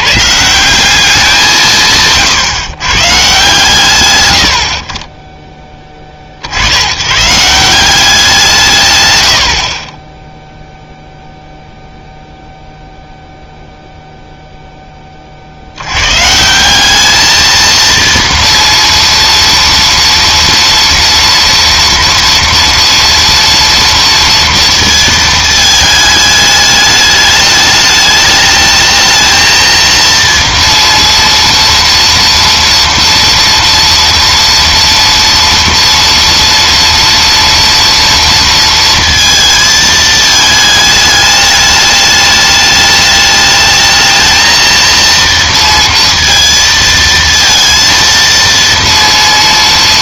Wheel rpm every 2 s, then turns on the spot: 180, 150, 60, 90, 140, 0, 0, 10, 180, 230, 230, 230, 230, 210, 210, 230, 230, 230, 230, 230, 210, 210, 230, 230, 230.
none